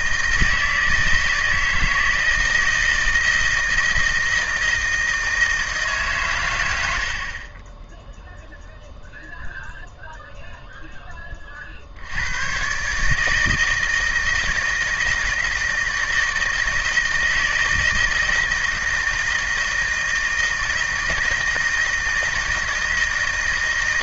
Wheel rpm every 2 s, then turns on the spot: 160, 160, 160, 90, 0, 10, 150, 160, 160, 160, 160, 160.
none